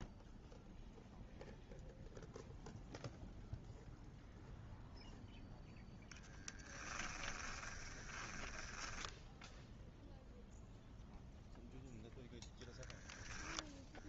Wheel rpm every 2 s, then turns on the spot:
0, 0, 0, 10, 10, 0, 10.
6-8